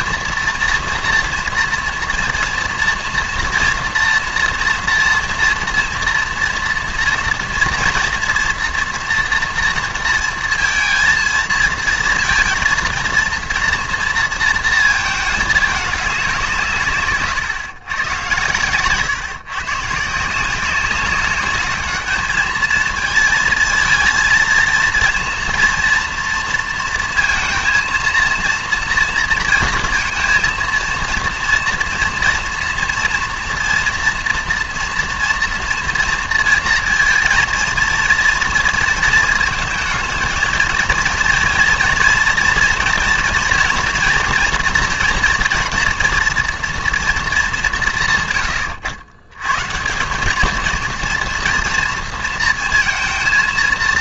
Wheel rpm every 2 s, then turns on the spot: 230, 240, 230, 230, 230, 230, 230, 230, 170, 120, 180, 220, 230, 230, 230, 230, 230, 230, 230, 230, 220, 230, 230, 230, 130, 210, 230.
none